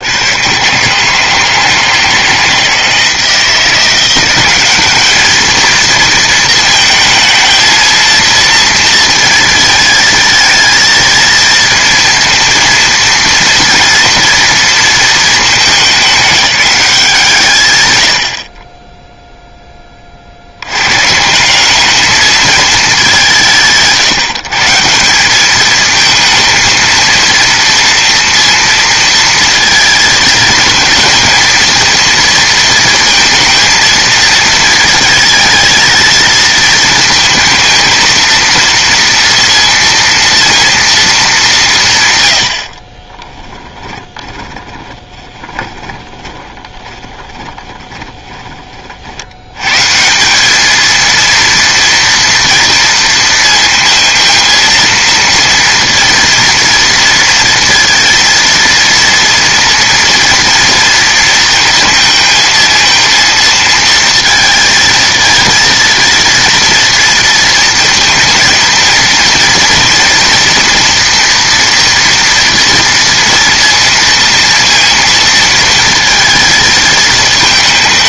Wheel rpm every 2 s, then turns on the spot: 130, 160, 200, 220, 230, 220, 230, 230, 190, 30, 80, 220, 160, 230, 230, 230, 230, 230, 230, 230, 230, 70, 20, 20, 40, 200, 230, 230, 230, 230, 230, 230, 230, 230, 230, 230, 230, 230, 220.
44-48